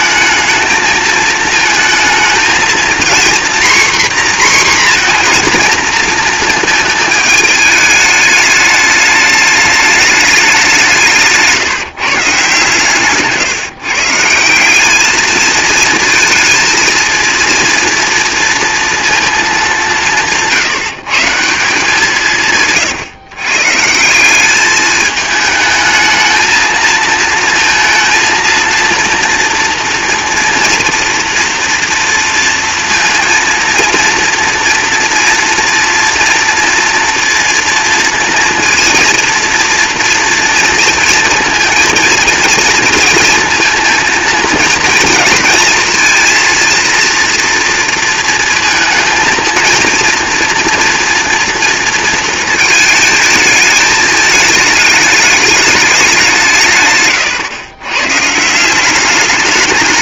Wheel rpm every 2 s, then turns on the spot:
220, 230, 250, 220, 210, 180, 140, 190, 230, 230, 170, 150, 210, 230, 230, 230, 230, 240, 230, 230, 230, 230, 230, 230, 220, 230, 230, 220, 150, 180.
none